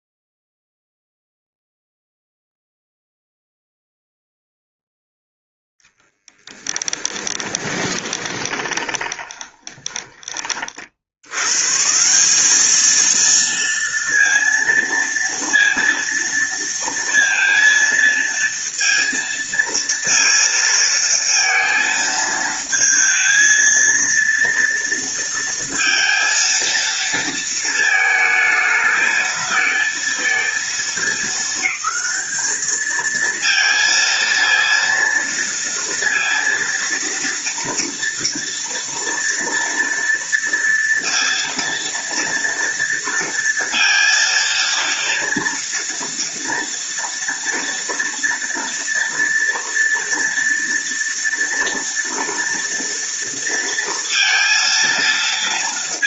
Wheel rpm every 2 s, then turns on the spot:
0, 0, 10, 20, 20, 100, 230, 230, 230, 230, 230, 230, 230, 230, 220, 220, 220, 230, 230, 230, 230, 230, 230, 230, 230, 230, 230, 230.
6-10